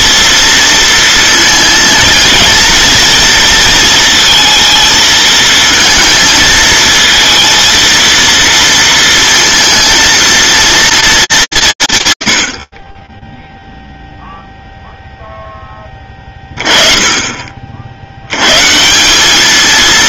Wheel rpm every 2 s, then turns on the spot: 230, 230, 220, 230, 230, 230, 60, 0, 20, 140.
none